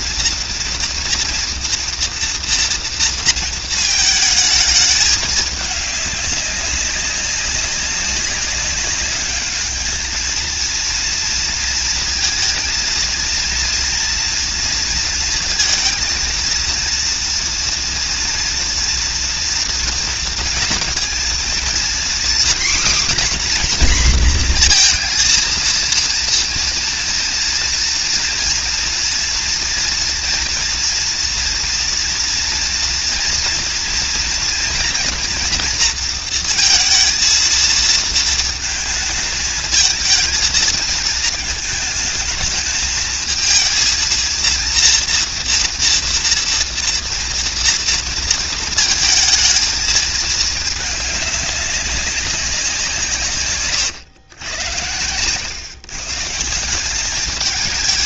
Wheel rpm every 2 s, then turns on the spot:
230, 230, 220, 200, 200, 230, 230, 230, 230, 230, 230, 260, 240, 230, 230, 230, 230, 230, 230, 220, 220, 220, 230, 230, 230, 210, 190, 100, 170.
none